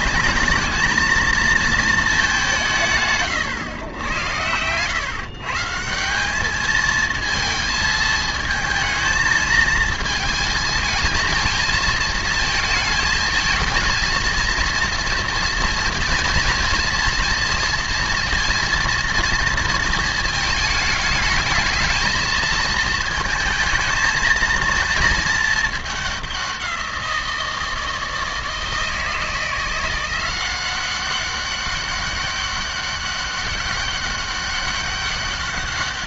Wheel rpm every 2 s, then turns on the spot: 210, 180, 110, 210, 220, 220, 220, 230, 230, 230, 220, 220, 230, 180, 160, 180, 200, 200.
none